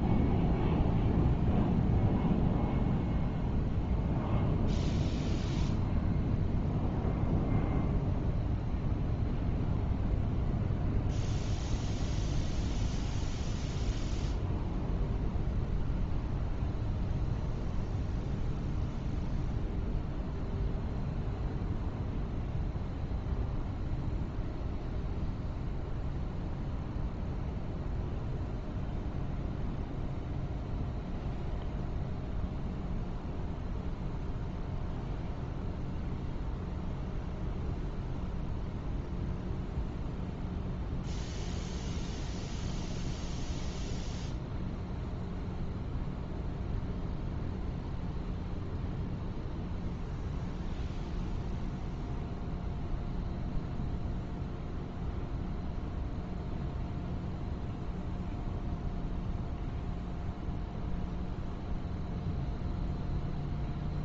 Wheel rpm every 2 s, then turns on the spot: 0, 0, 0, 0, 0, 0, 0, 0, 0, 0, 0, 0, 0, 0, 0, 0, 0, 0, 0, 0, 0, 0, 0, 0, 0, 0, 0, 0, 0, 0, 0, 0.
none